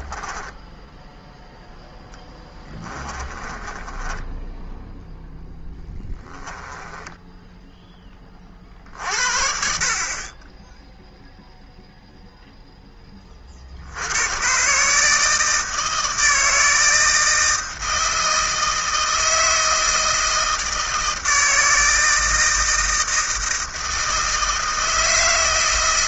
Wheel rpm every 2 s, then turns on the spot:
10, 10, 10, 10, 40, 10, 10, 130, 160, 160, 160, 160, 160.
0-8